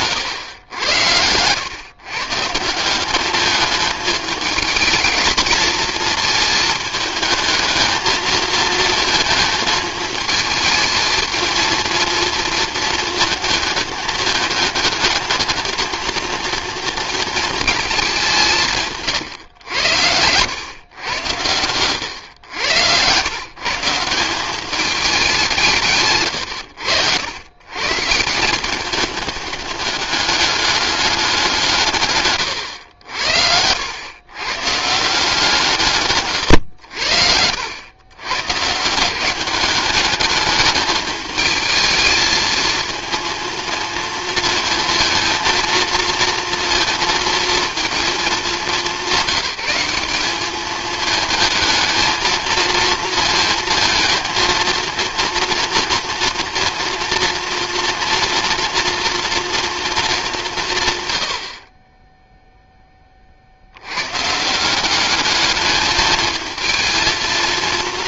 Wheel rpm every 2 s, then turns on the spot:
100, 160, 220, 220, 230, 220, 230, 220, 230, 160, 110, 120, 200, 100, 190, 210, 100, 140, 110, 140, 210, 220, 230, 230, 210, 210, 230, 230, 230, 240, 150, 10, 180, 220.
32-34 36-38